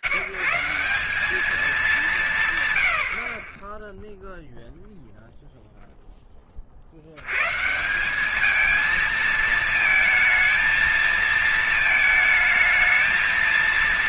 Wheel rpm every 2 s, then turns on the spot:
140, 150, 0, 50, 210, 220, 220.
none